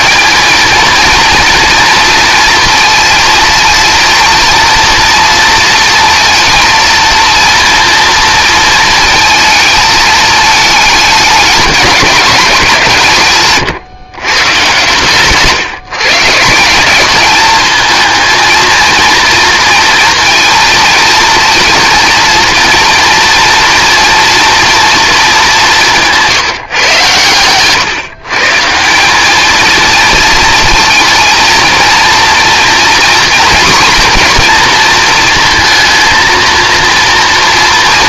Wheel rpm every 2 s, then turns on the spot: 220, 230, 230, 230, 230, 220, 160, 140, 190, 230, 230, 230, 230, 130, 170, 230, 240, 230, 230.
none